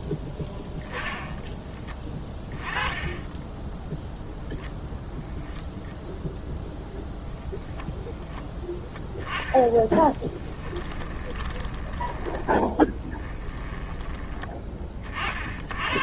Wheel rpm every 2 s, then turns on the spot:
0, 10, 0, 0, 10, 20, 10, 30.
10-14